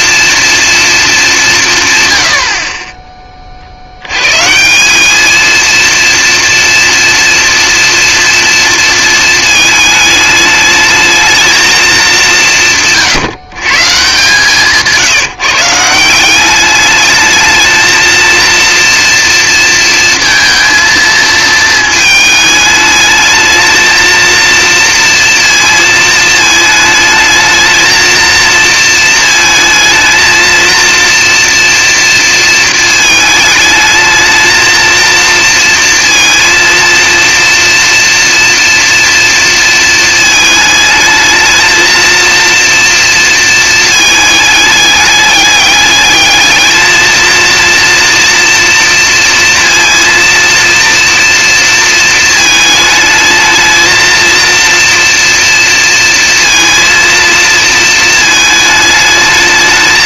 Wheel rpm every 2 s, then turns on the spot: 230, 40, 160, 230, 230, 210, 180, 160, 200, 230, 230, 210, 230, 220, 230, 220, 230, 230, 230, 240, 220, 230, 210, 220, 230, 230, 220, 230, 230, 220.
none